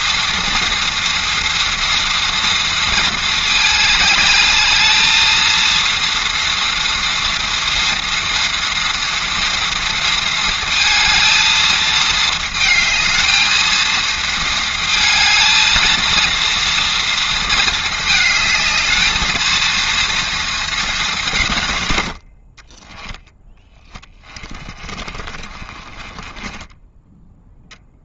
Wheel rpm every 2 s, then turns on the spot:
230, 220, 220, 230, 230, 230, 220, 220, 230, 220, 190, 10, 30, 10.
22-28